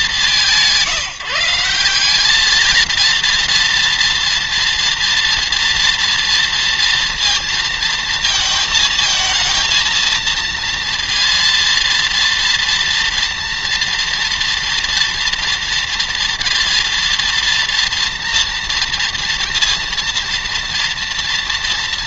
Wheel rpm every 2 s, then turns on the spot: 150, 220, 240, 230, 220, 230, 230, 230, 230, 230, 230.
none